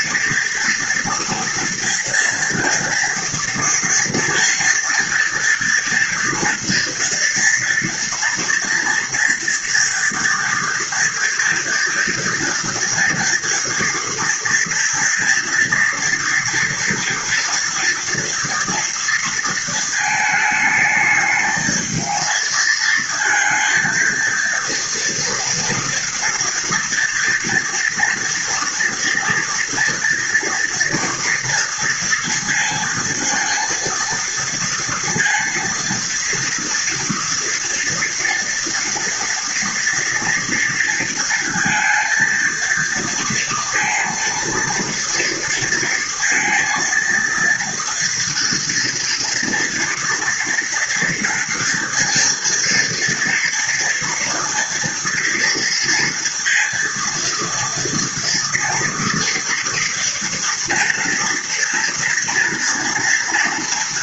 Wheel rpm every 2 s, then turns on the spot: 230, 230, 230, 230, 230, 230, 230, 230, 230, 230, 220, 230, 230, 230, 240, 230, 230, 230, 230, 240, 230, 230, 230, 230, 230, 230, 230, 230, 230, 230, 230, 230.
none